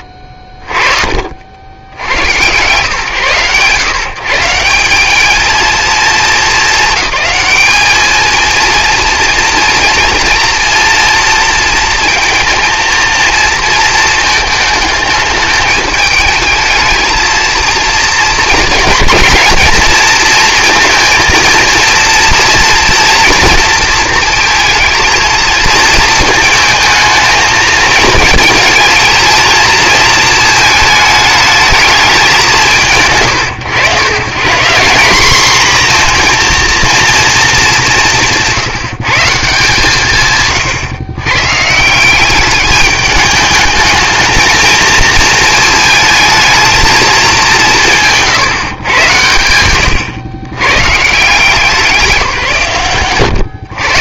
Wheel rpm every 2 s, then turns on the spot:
40, 130, 180, 210, 230, 230, 230, 210, 220, 220, 230, 230, 230, 220, 230, 220, 120, 180, 230, 180, 150, 200, 220, 220, 130, 130, 140.
none